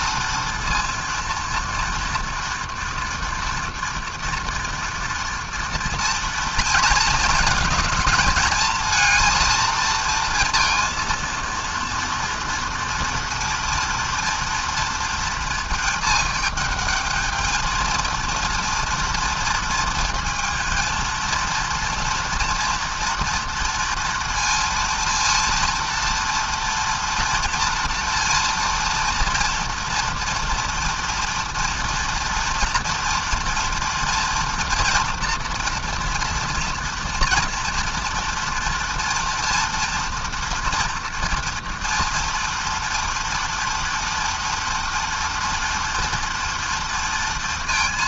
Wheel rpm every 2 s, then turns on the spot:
230, 230, 230, 230, 220, 230, 230, 230, 210, 230, 230, 240, 230, 240, 230, 230, 230, 230, 230, 230, 230, 230, 230, 230.
none